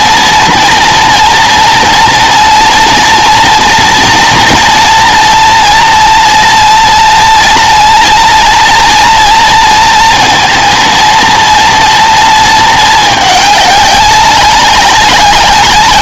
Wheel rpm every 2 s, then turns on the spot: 240, 230, 230, 230, 230, 230, 210, 190.
none